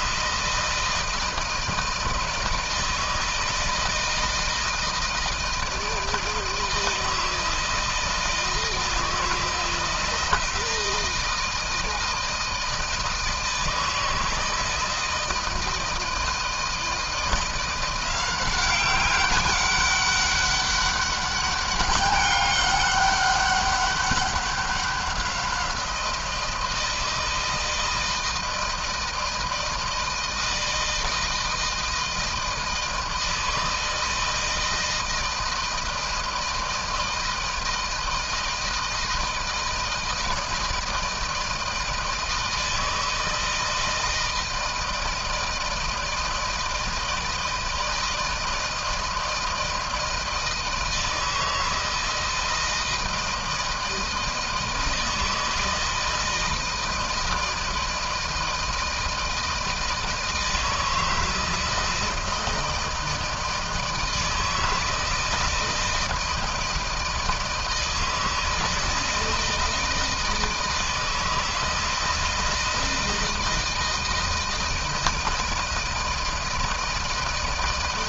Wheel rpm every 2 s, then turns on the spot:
160, 160, 160, 160, 160, 160, 160, 160, 170, 190, 200, 200, 190, 160, 160, 160, 160, 160, 160, 160, 160, 160, 160, 160, 160, 160, 160, 160, 160, 160, 160, 160, 160, 160, 160, 160, 160, 160, 160.
none